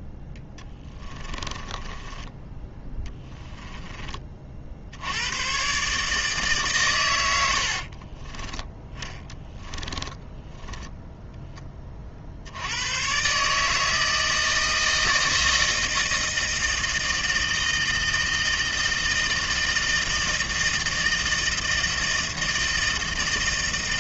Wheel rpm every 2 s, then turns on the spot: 20, 10, 60, 130, 10, 10, 80, 160, 160, 160, 160, 160.
0-2 8-12